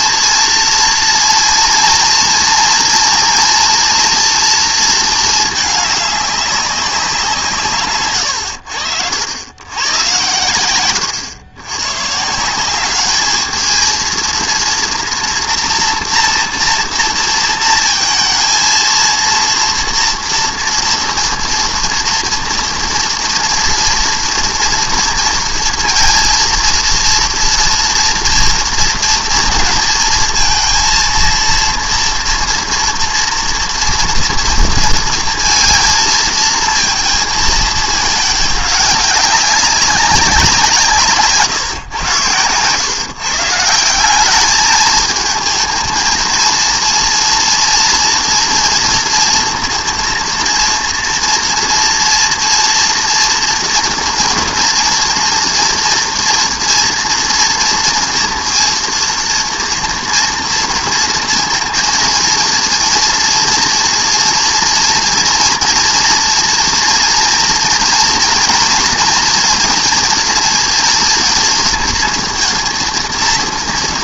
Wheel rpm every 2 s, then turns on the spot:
230, 230, 220, 200, 90, 110, 190, 230, 230, 230, 230, 230, 230, 230, 230, 230, 230, 230, 230, 210, 170, 120, 210, 230, 230, 230, 230, 230, 230, 230, 230, 230, 230, 240, 240, 220, 230.
none